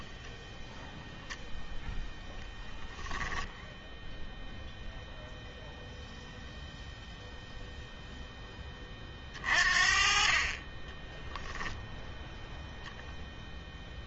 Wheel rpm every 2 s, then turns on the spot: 0, 10, 0, 0, 20, 20, 0.
none